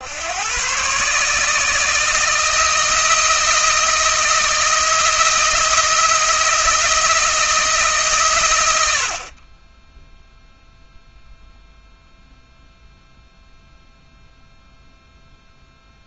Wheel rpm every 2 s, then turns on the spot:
140, 160, 160, 170, 90, 0, 0, 0.
none